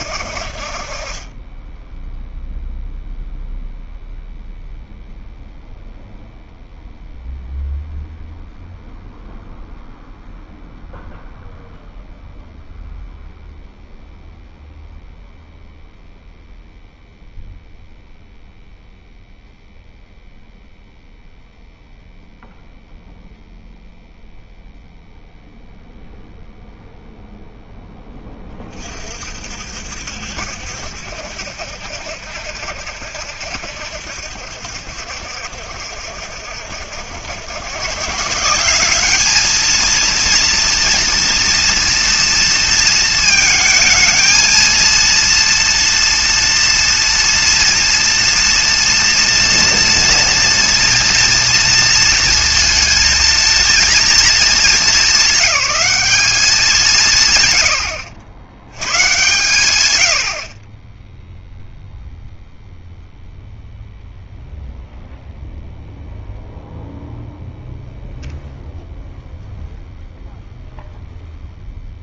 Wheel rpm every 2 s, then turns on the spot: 40, 0, 0, 0, 0, 0, 0, 0, 0, 0, 0, 0, 0, 0, 30, 70, 60, 70, 70, 180, 230, 230, 230, 230, 230, 240, 230, 210, 190, 110, 30, 0, 0, 0, 0, 0.
none